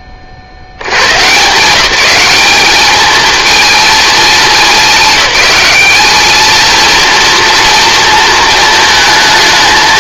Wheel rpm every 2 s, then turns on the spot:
70, 210, 190, 230, 220.
none